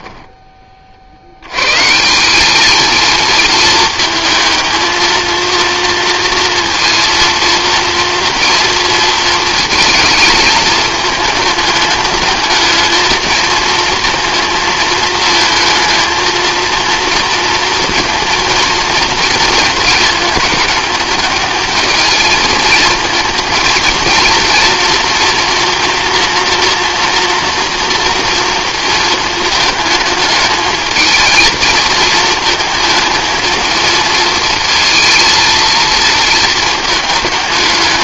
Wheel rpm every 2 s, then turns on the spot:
20, 220, 220, 230, 230, 220, 210, 220, 230, 230, 220, 220, 230, 230, 230, 220, 220, 230, 220.
none